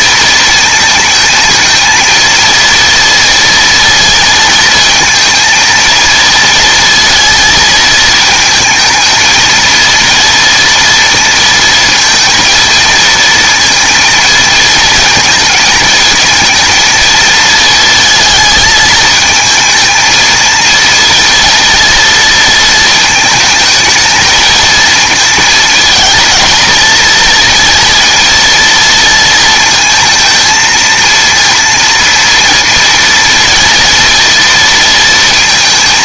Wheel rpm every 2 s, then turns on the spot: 230, 230, 230, 230, 220, 230, 230, 230, 230, 220, 230, 230, 220, 230, 230, 230, 230, 230.
none